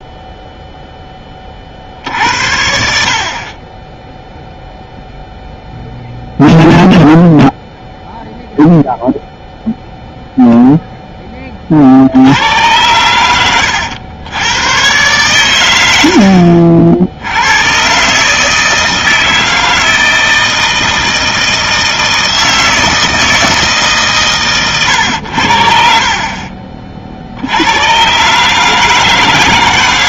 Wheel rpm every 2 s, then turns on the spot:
0, 70, 0, 0, 0, 0, 100, 100, 70, 160, 160, 160, 120, 40, 150.
none